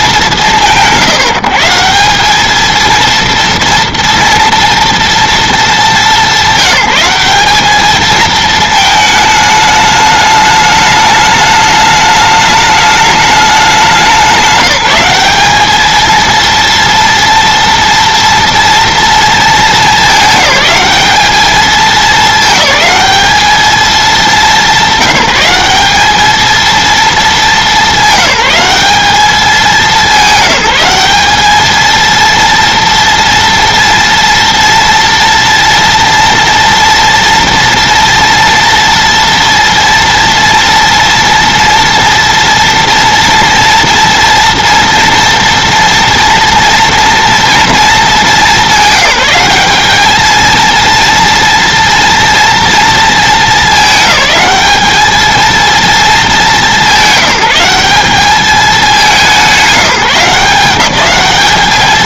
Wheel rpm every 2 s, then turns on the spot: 170, 220, 230, 190, 220, 210, 210, 190, 230, 230, 210, 210, 190, 220, 200, 190, 230, 230, 230, 230, 240, 230, 230, 240, 200, 230, 230, 210, 200, 200, 180.
none